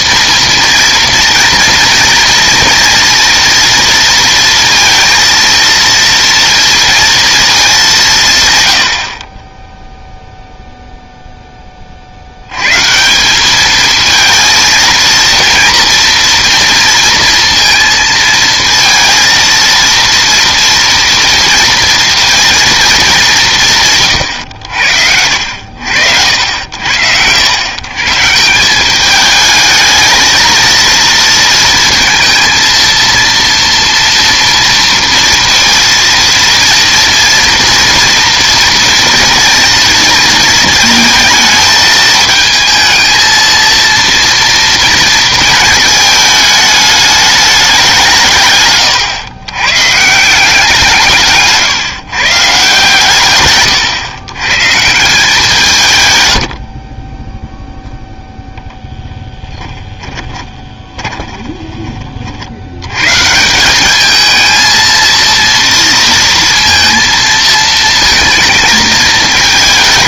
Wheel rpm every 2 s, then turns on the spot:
240, 230, 230, 230, 90, 0, 120, 230, 230, 230, 230, 230, 90, 70, 170, 220, 230, 230, 230, 230, 220, 220, 230, 210, 130, 170, 140, 150, 60, 0, 20, 80, 220, 230, 230.
60-62